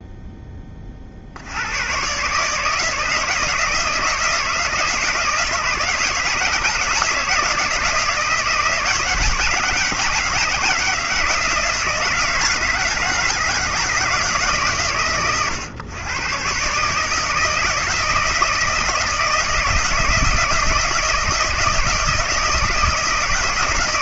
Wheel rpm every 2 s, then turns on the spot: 40, 160, 160, 160, 160, 160, 160, 130, 140, 160, 160, 160.
none